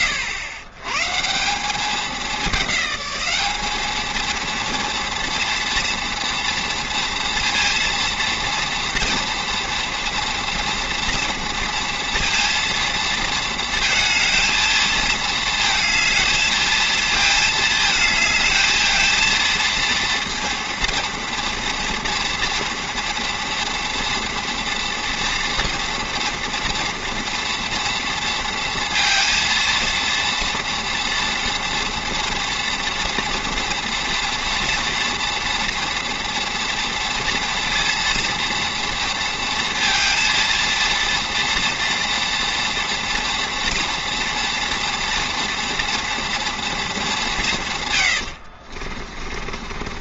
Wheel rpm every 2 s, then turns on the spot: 100, 200, 230, 230, 230, 240, 230, 220, 220, 220, 230, 230, 230, 230, 230, 230, 230, 230, 230, 230, 230, 240, 230, 230, 70.
48-50